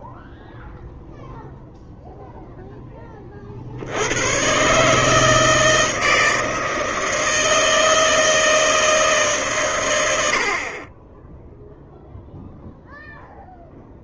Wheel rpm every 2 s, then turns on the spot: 0, 20, 140, 160, 160, 40, 0.
none